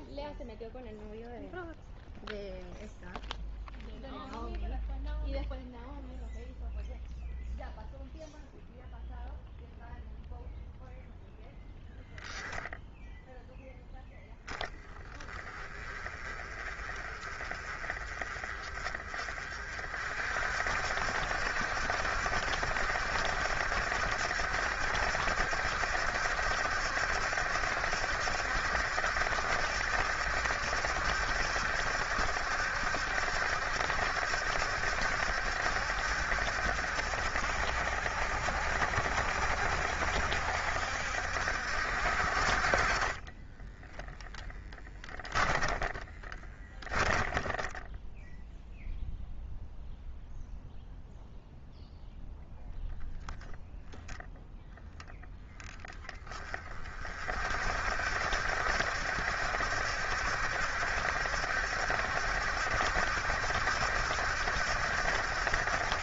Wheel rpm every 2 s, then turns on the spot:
0, 0, 0, 0, 0, 0, 0, 10, 30, 30, 60, 70, 70, 70, 70, 70, 70, 70, 70, 60, 60, 40, 10, 10, 0, 0, 0, 0, 30, 70, 70, 70, 70.
46-48